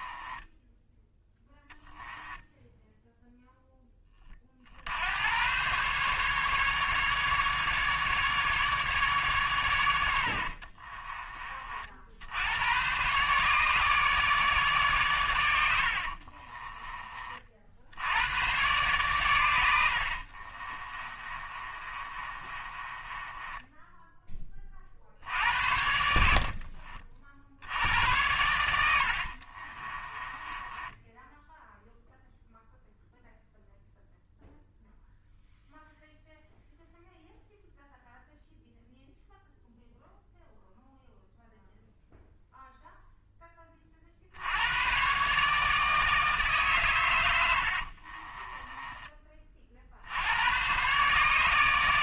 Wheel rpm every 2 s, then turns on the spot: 10, 0, 60, 150, 150, 40, 110, 140, 30, 120, 30, 20, 40, 40, 80, 10, 0, 0, 0, 0, 0, 0, 100, 130, 20, 120.
10-12 16-18 20-24 28-32 48-50